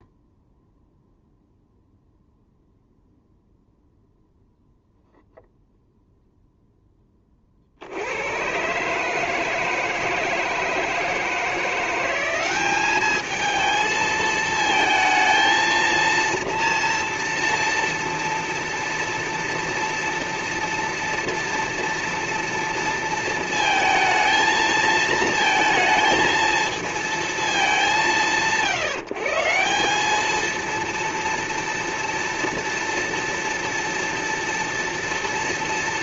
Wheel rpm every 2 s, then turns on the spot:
0, 0, 0, 0, 110, 160, 190, 220, 230, 230, 230, 230, 220, 220, 150, 220, 230, 230.
none